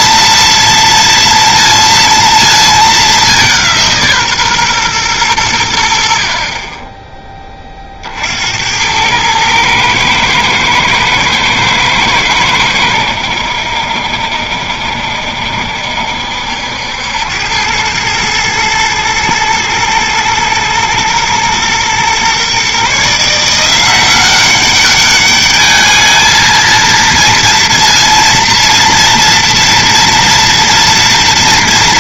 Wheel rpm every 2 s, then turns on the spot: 230, 220, 140, 40, 80, 110, 100, 70, 70, 110, 120, 130, 190, 220, 230, 230.
none